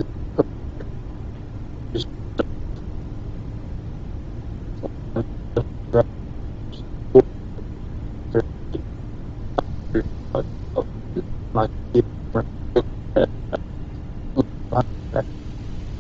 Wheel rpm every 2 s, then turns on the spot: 0, 0, 0, 0, 0, 0, 0, 0.
none